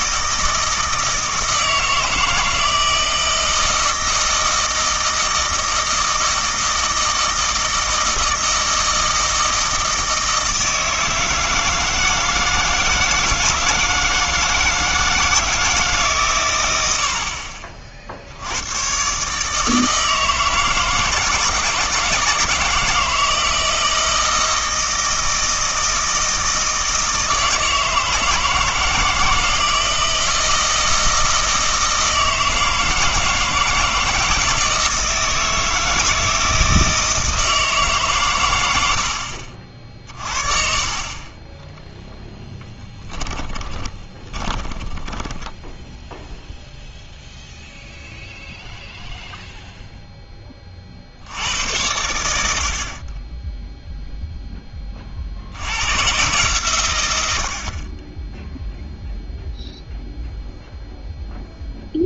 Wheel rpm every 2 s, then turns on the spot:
160, 160, 160, 160, 160, 160, 160, 160, 100, 100, 160, 160, 160, 160, 160, 160, 160, 160, 160, 90, 40, 10, 20, 0, 0, 20, 60, 10, 130, 0, 0.
42-46